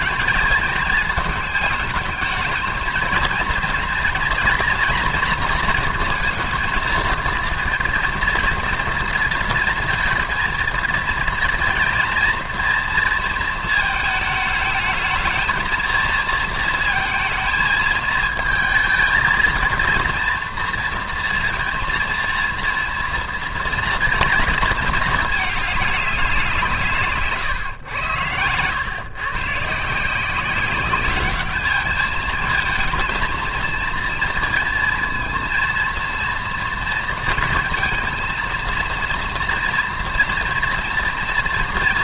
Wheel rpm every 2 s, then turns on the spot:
210, 220, 230, 230, 230, 230, 240, 220, 230, 220, 230, 230, 220, 160, 110, 200, 220, 230, 230, 230, 230.
none